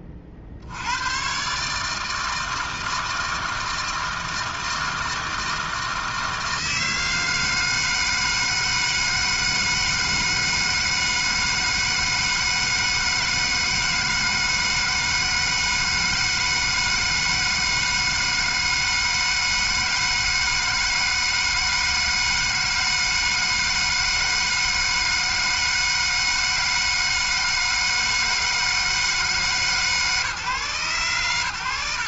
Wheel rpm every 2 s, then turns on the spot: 70, 160, 160, 160, 160, 160, 160, 160, 160, 160, 160, 160, 160, 160, 160, 120.
none